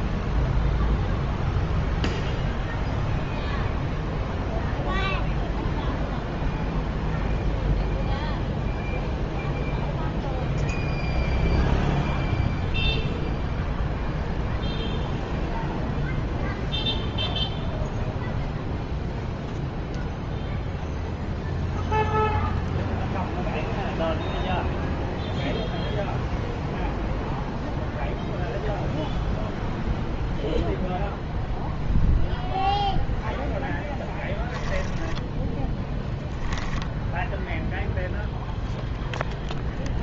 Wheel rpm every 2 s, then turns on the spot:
0, 0, 0, 0, 0, 0, 0, 0, 0, 0, 0, 0, 0, 0, 0, 0, 0, 10, 0, 0.
34-36